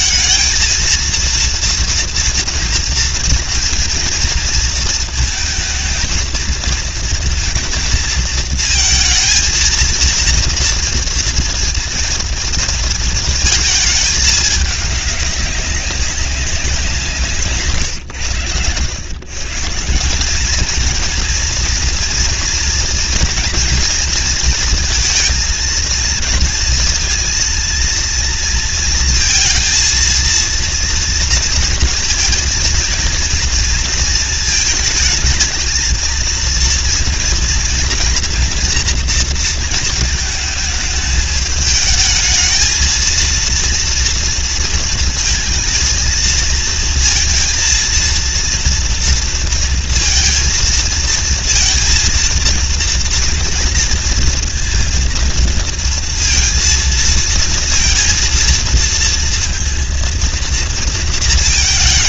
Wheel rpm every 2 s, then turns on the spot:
230, 240, 230, 230, 220, 230, 230, 210, 190, 110, 220, 240, 230, 230, 230, 230, 230, 220, 230, 230, 220, 220, 230, 230, 230, 230, 230, 230, 230, 230, 230.
none